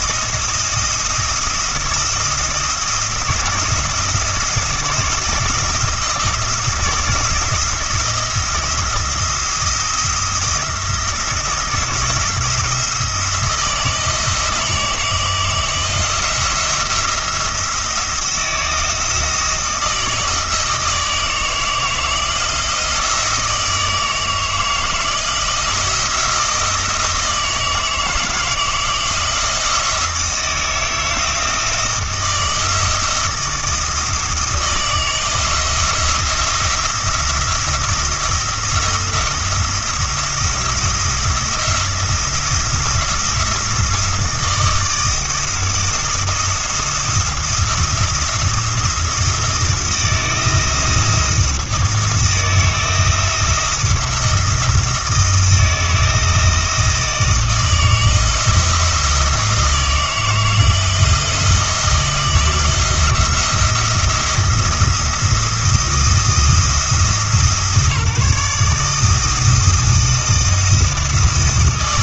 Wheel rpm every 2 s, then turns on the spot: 170, 170, 170, 170, 170, 170, 170, 160, 170, 160, 160, 160, 160, 160, 160, 160, 170, 160, 170, 160, 160, 170, 160, 170, 170, 160, 170, 170, 160, 170, 160, 170, 170, 160, 160, 160.
none